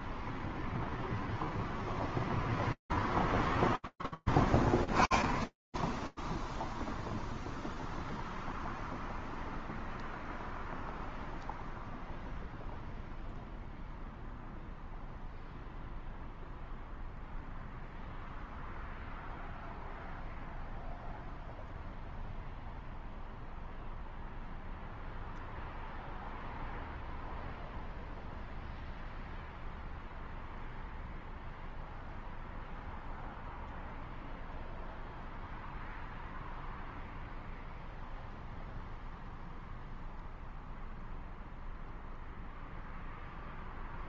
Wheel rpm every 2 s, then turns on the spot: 0, 0, 0, 0, 0, 0, 0, 0, 0, 0, 0, 0, 0, 0, 0, 0, 0, 0, 0, 0, 0, 0.
none